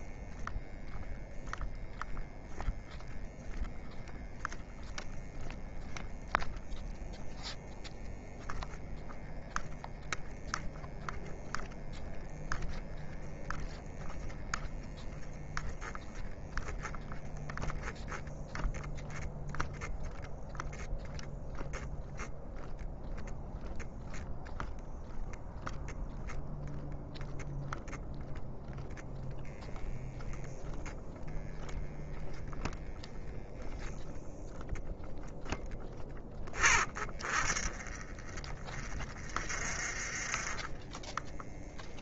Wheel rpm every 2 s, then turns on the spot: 0, 0, 0, 0, 0, 0, 10, 0, 0, 0, 0, 0, 0, 0, 0, 0, 0, 0, 20, 20, 10.
none